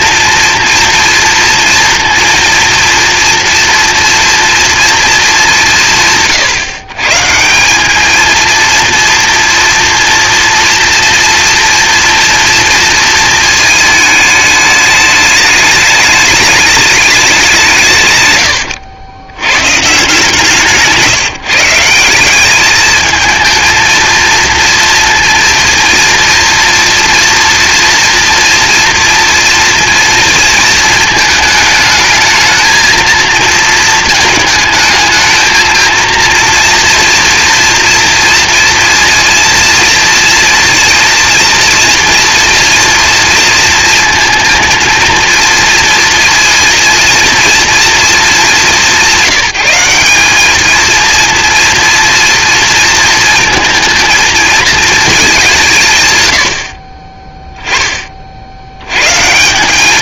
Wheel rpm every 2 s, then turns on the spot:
240, 240, 230, 140, 230, 230, 230, 210, 210, 90, 160, 210, 230, 230, 230, 220, 230, 220, 230, 230, 230, 240, 230, 230, 200, 220, 230, 230, 50, 100.
20-22